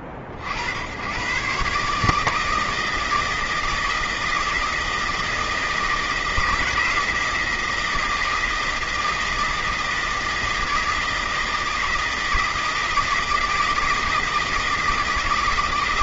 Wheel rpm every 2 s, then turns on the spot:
70, 160, 160, 160, 160, 160, 160, 160.
none